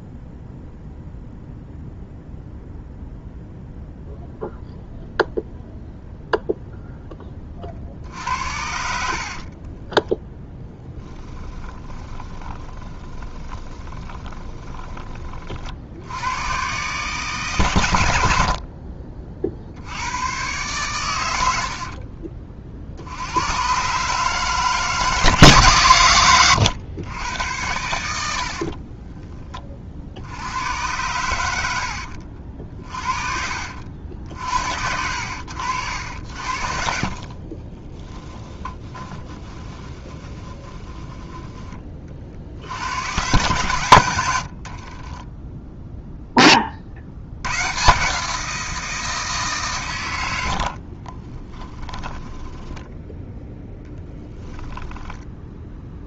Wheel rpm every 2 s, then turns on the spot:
0, 0, 0, 10, 60, 10, 20, 20, 140, 50, 110, 70, 160, 100, 40, 110, 40, 80, 50, 20, 10, 100, 40, 60, 170, 40, 10, 10.
8-14 28-30 36-42 44-46 50-56